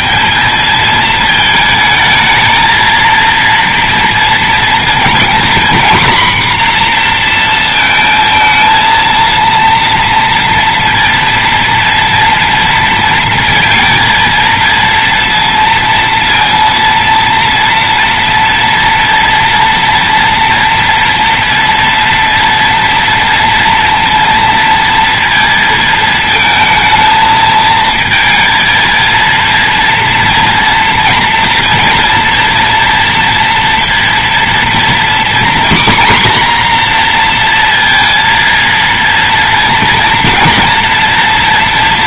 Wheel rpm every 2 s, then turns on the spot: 220, 230, 230, 240, 230, 230, 230, 230, 230, 230, 230, 230, 230, 220, 220, 240, 230, 240, 240, 230, 230.
none